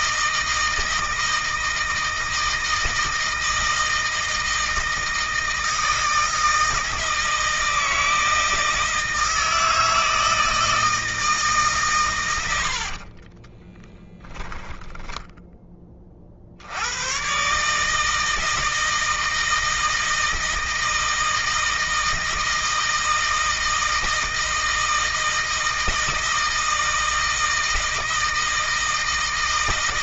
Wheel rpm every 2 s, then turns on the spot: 160, 160, 160, 160, 160, 160, 80, 10, 80, 160, 160, 160, 160, 160, 160.
12-16